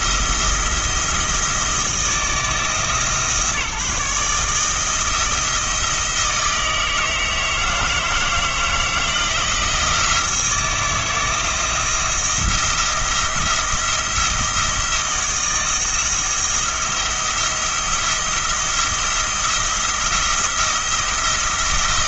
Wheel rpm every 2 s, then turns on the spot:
170, 160, 160, 160, 160, 160, 170, 160, 170, 170, 170.
none